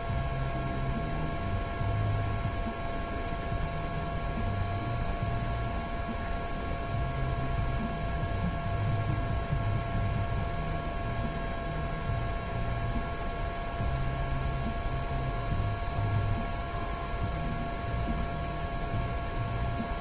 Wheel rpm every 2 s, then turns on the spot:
0, 0, 0, 0, 0, 0, 0, 0, 0, 0.
none